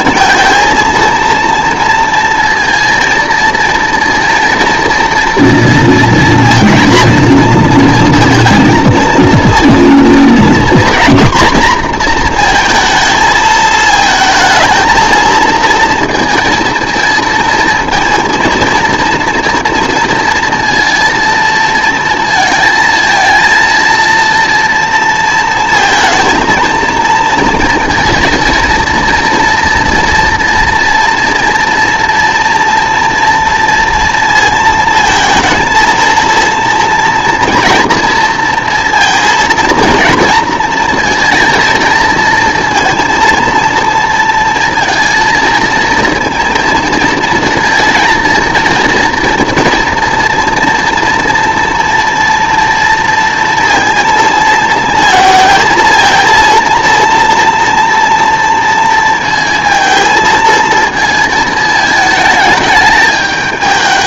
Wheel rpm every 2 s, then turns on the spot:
230, 220, 230, 230, 230, 240, 230, 220, 230, 230, 230, 220, 230, 230, 230, 240, 230, 230, 230, 230, 230, 230, 230, 230, 230, 240, 230, 230, 230, 230, 230, 220.
none